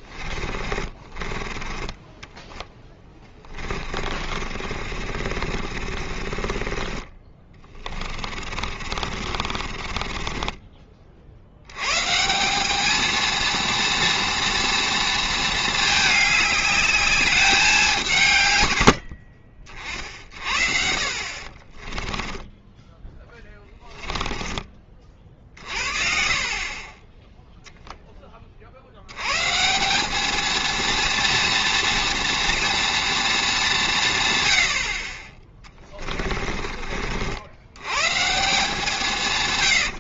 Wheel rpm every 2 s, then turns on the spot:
20, 10, 40, 30, 50, 30, 200, 230, 210, 110, 60, 10, 20, 40, 40, 230, 230, 80, 40, 170.
0-10 22-24 36-38